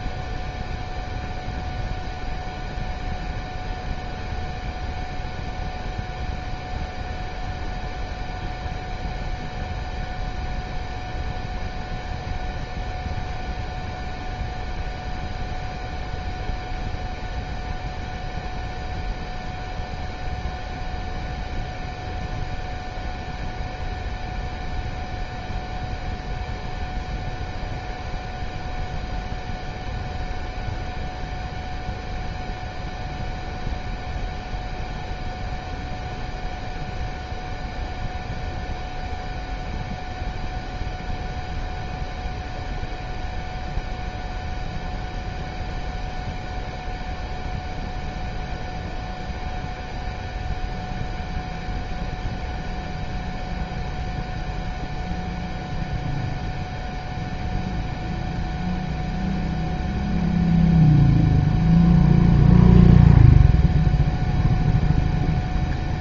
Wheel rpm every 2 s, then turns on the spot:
0, 0, 0, 0, 0, 0, 0, 0, 0, 0, 0, 0, 0, 0, 0, 0, 0, 0, 0, 0, 0, 0, 0, 0, 0, 0, 0, 0, 0, 0, 0, 0, 0.
none